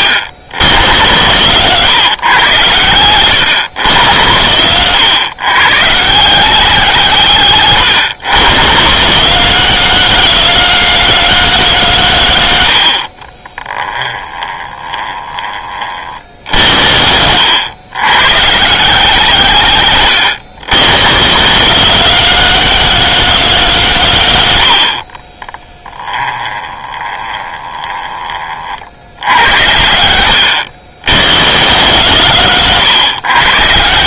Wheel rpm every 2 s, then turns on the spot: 50, 60, 60, 90, 70, 90, 30, 10, 40, 80, 60, 90, 20, 10, 30, 50, 80.
none